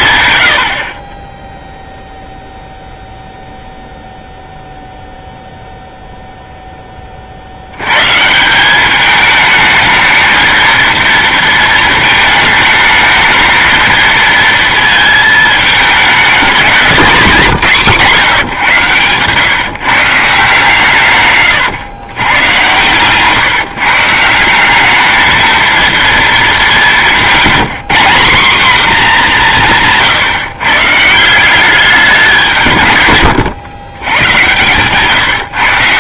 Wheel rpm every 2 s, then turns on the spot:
80, 0, 0, 0, 170, 220, 220, 230, 220, 160, 150, 120, 190, 210, 220, 130, 170, 120.
34-36